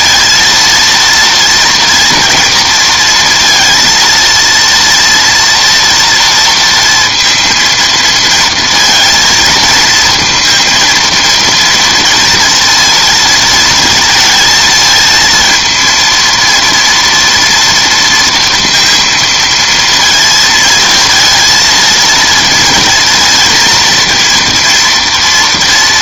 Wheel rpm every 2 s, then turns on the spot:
230, 230, 230, 230, 230, 230, 230, 220, 230, 230, 230, 230, 230.
none